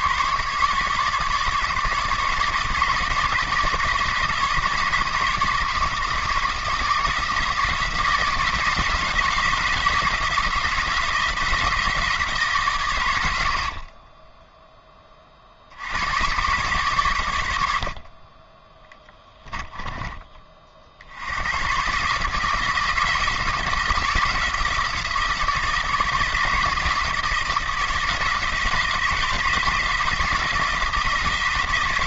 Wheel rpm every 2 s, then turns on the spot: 150, 150, 150, 160, 170, 170, 130, 10, 120, 20, 60, 160, 160, 160, 160, 160.
18-20